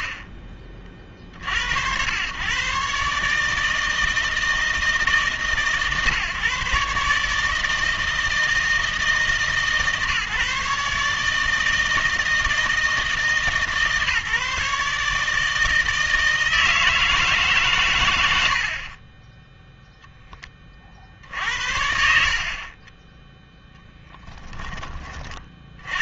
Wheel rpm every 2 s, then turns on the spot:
50, 130, 160, 140, 160, 140, 160, 150, 160, 70, 40, 30, 10.
none